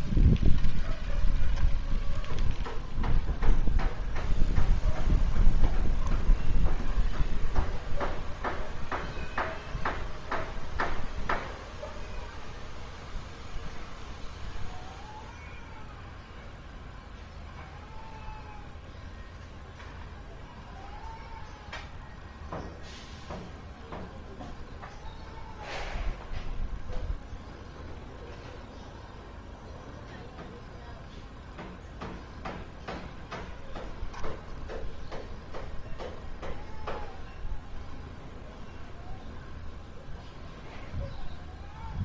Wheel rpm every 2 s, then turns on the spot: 0, 0, 0, 0, 0, 0, 0, 0, 0, 0, 0, 0, 0, 0, 0, 0, 0, 0, 0, 0, 0.
none